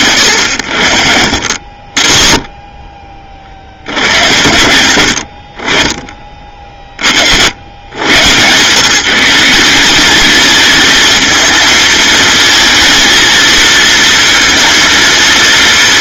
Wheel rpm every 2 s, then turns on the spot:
70, 30, 80, 60, 170, 220, 230, 230.
none